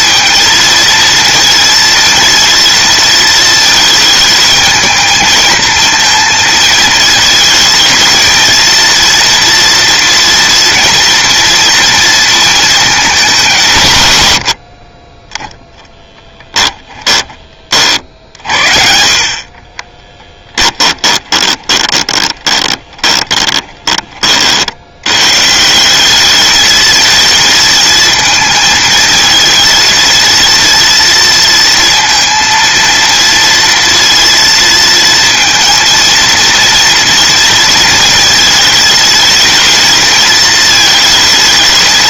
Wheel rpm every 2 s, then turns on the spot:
230, 230, 220, 220, 230, 230, 210, 30, 10, 60, 10, 20, 80, 210, 230, 230, 230, 230, 230, 220, 220.
16-18 20-24